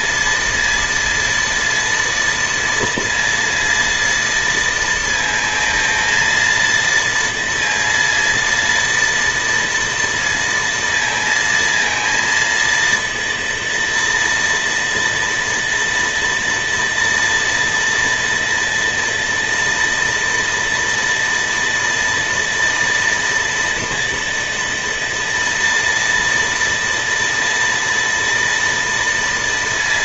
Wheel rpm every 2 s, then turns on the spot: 230, 230, 230, 230, 230, 230, 230, 230, 230, 240, 230, 230, 230, 230, 230.
none